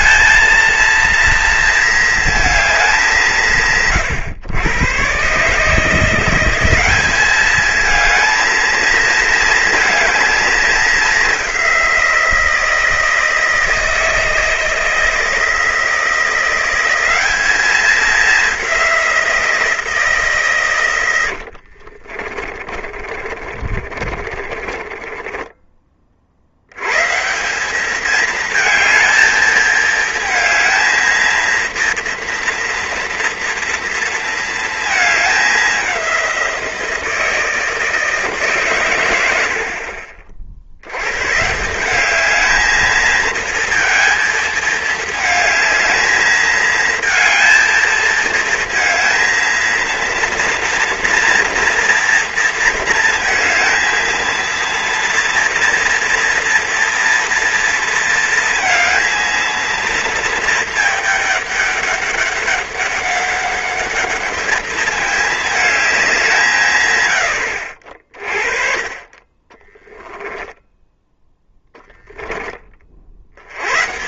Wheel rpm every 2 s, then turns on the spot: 220, 210, 120, 190, 230, 210, 170, 160, 190, 190, 120, 40, 30, 100, 220, 220, 230, 220, 170, 130, 90, 220, 220, 220, 230, 230, 230, 230, 230, 230, 220, 200, 210, 120, 30, 10, 30.
22-26